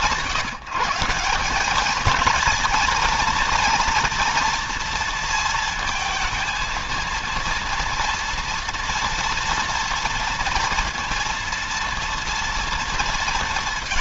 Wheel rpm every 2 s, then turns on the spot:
160, 220, 230, 220, 230, 230, 230.
none